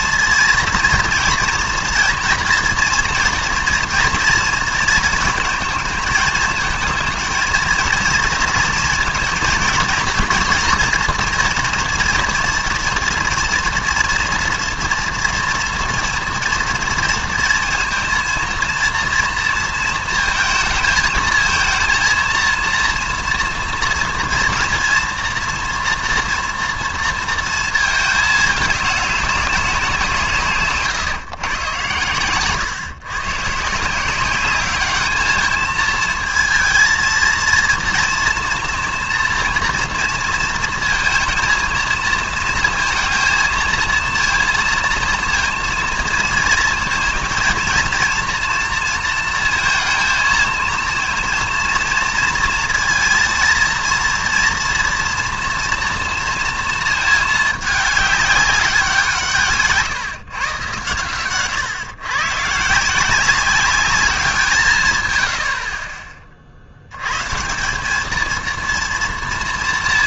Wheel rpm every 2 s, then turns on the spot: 230, 230, 230, 220, 230, 230, 230, 230, 230, 230, 230, 230, 230, 230, 220, 160, 130, 200, 230, 230, 230, 230, 230, 230, 230, 230, 230, 230, 230, 200, 140, 140, 170, 50, 230.
30-32